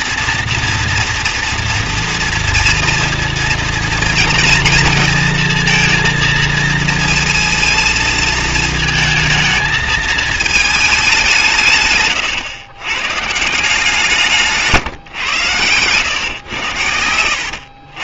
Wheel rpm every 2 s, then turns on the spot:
240, 230, 230, 230, 220, 220, 120, 150, 110.
none